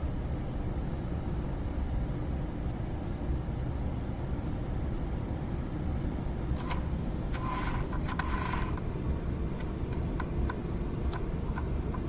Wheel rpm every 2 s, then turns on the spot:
0, 0, 0, 10, 10, 0.
none